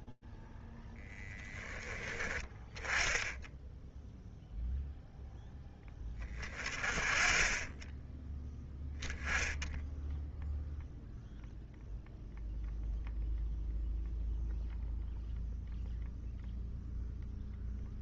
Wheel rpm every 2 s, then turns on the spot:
10, 10, 0, 30, 0, 0, 0, 0, 0.
none